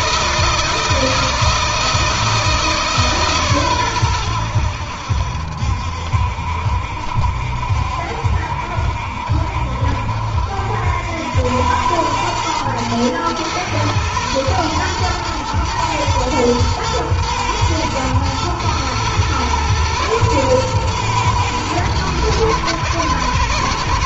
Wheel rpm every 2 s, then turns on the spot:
160, 150, 80, 70, 70, 80, 110, 110, 110, 110, 120, 120.
none